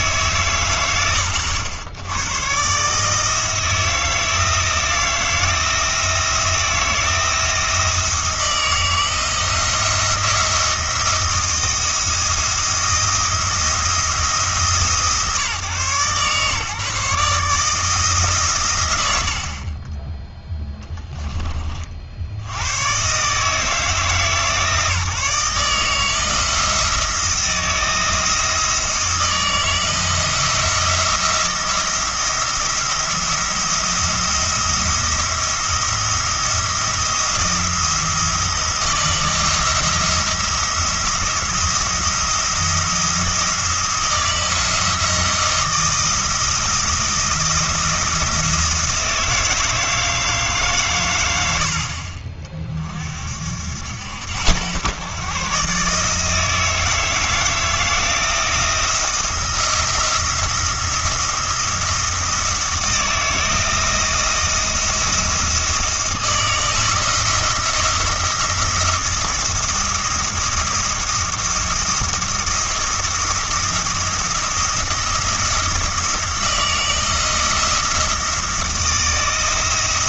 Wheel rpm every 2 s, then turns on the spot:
90, 140, 170, 170, 160, 170, 170, 160, 140, 130, 10, 100, 160, 160, 160, 170, 170, 170, 170, 170, 170, 170, 170, 170, 170, 140, 40, 100, 160, 170, 170, 160, 170, 170, 170, 170, 170, 170, 170, 160.
20-22